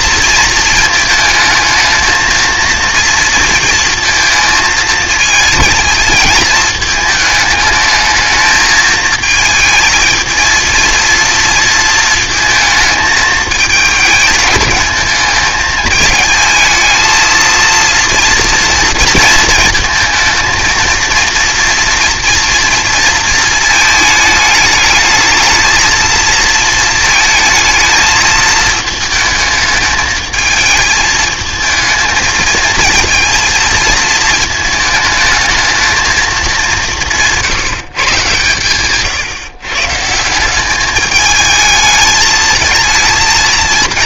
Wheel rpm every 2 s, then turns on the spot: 230, 230, 220, 220, 220, 230, 220, 220, 220, 230, 230, 230, 220, 230, 220, 220, 220, 220, 210, 140, 190, 220.
none